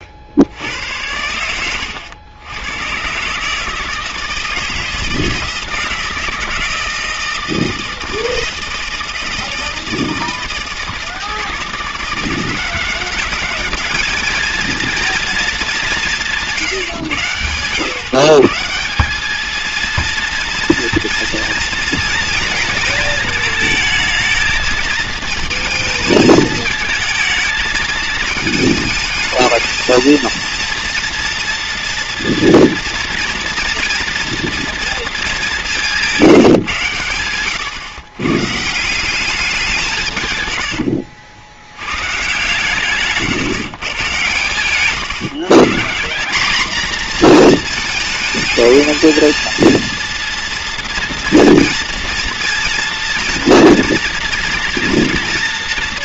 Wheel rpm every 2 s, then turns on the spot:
70, 100, 160, 160, 160, 160, 180, 220, 160, 150, 230, 220, 220, 220, 220, 230, 230, 230, 160, 140, 110, 140, 130, 220, 220, 230, 230, 230.
none